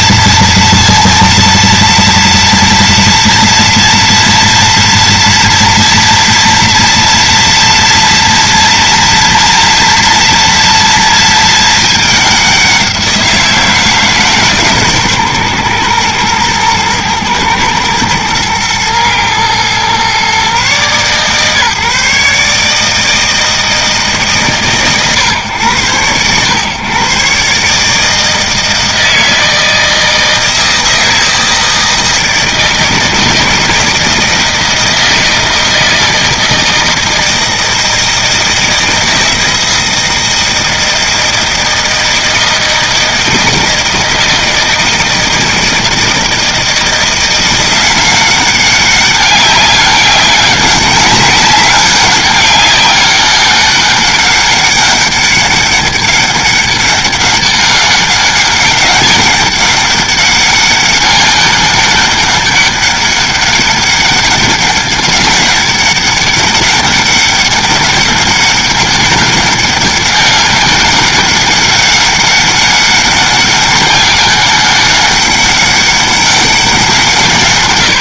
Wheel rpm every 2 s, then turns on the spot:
230, 230, 230, 230, 230, 230, 190, 140, 110, 110, 130, 150, 130, 120, 160, 160, 160, 160, 160, 160, 160, 160, 160, 160, 190, 190, 200, 200, 200, 200, 200, 200, 200, 200, 200, 190, 200, 200, 200.
none